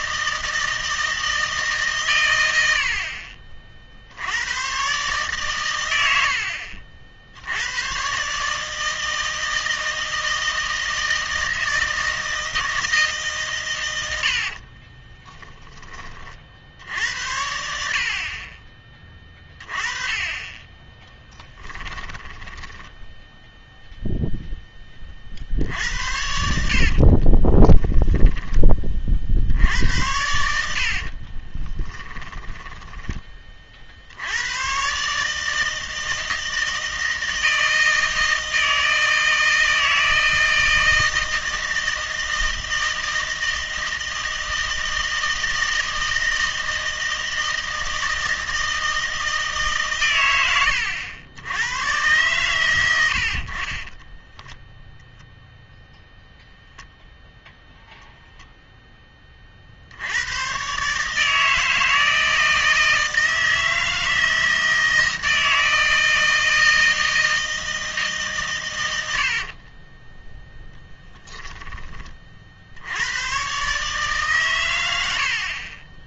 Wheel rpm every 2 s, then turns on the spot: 160, 80, 130, 60, 160, 160, 160, 40, 70, 30, 20, 10, 10, 60, 20, 70, 20, 120, 160, 160, 160, 160, 160, 160, 160, 100, 110, 10, 0, 0, 130, 160, 160, 160, 110, 0, 70, 110.
14-16 22-24 26-28 30-34